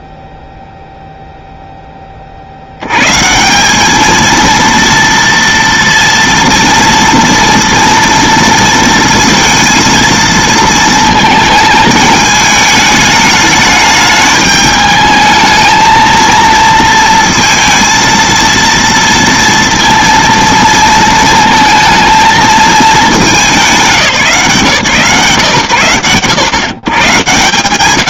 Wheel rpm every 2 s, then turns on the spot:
0, 70, 230, 230, 230, 230, 210, 210, 230, 230, 230, 220, 150, 110.
none